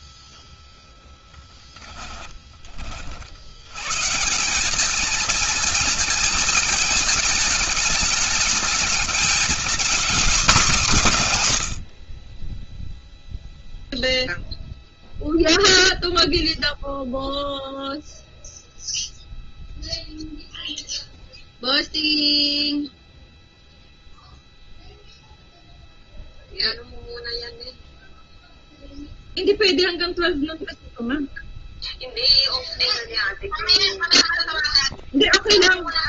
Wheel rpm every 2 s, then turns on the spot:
20, 40, 190, 220, 220, 220, 20, 0, 0, 0, 0, 0, 0, 0, 0, 0, 0, 0.
0-2